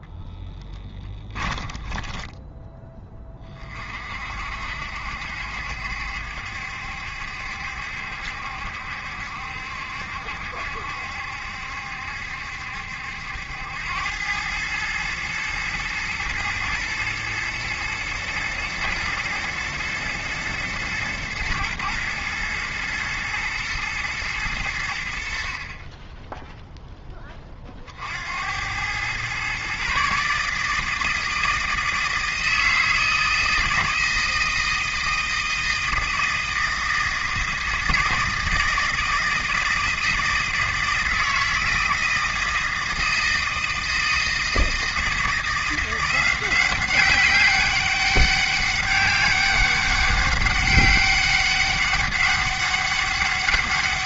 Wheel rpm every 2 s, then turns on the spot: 10, 10, 60, 70, 70, 70, 70, 110, 120, 110, 110, 120, 80, 10, 110, 160, 160, 160, 160, 160, 160, 160, 160, 190, 200, 200, 200.
0-2